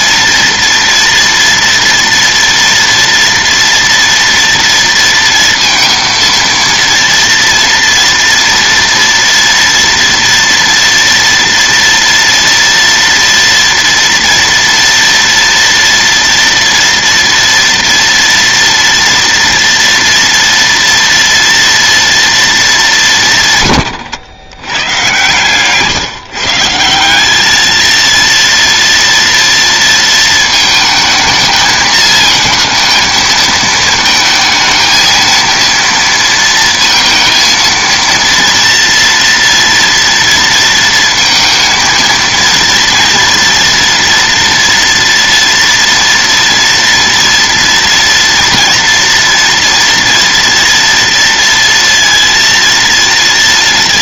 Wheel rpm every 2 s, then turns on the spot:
230, 240, 230, 230, 230, 230, 230, 230, 230, 230, 230, 220, 110, 150, 230, 220, 220, 230, 230, 230, 230, 230, 240, 230, 230, 240, 230.
none